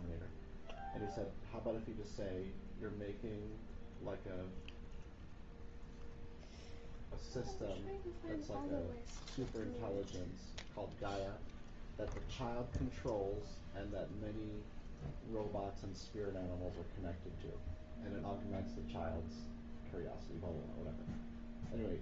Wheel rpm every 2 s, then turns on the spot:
0, 0, 0, 0, 0, 0, 0, 0, 0, 0, 0.
none